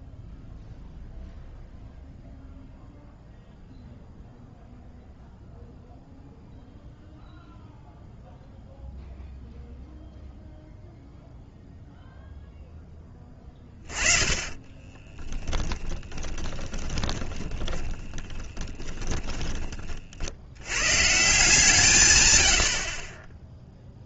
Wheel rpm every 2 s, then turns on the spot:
0, 0, 0, 0, 0, 0, 0, 10, 20, 10, 90, 100.
14-20